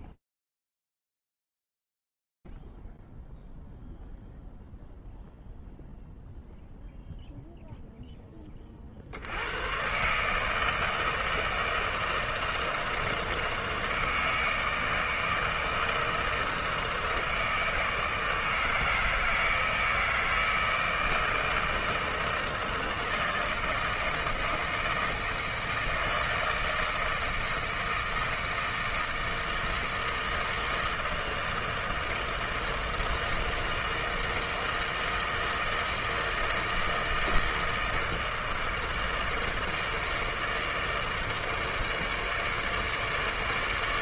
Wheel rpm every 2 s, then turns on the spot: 20, 70, 0, 0, 30, 160, 160, 160, 160, 160, 160, 160, 160, 160, 160, 160, 160, 160, 160, 160, 160, 150.
none